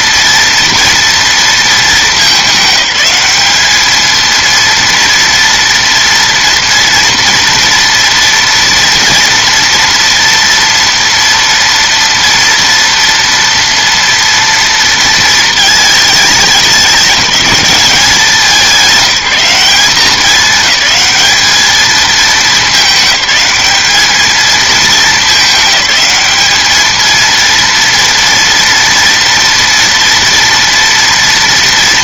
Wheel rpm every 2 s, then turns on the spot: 230, 210, 230, 230, 230, 230, 230, 230, 210, 190, 210, 220, 220, 210, 230, 230.
none